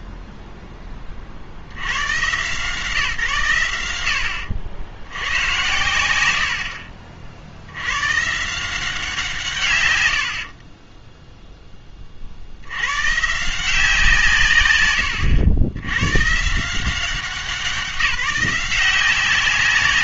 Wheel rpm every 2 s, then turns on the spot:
10, 150, 70, 70, 170, 40, 90, 130, 160, 180.
10-12